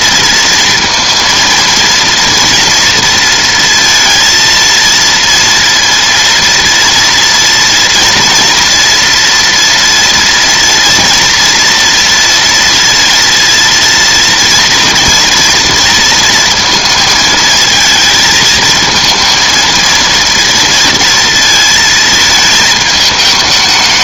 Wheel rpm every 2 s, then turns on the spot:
230, 230, 230, 230, 240, 230, 230, 230, 230, 220, 230, 220.
none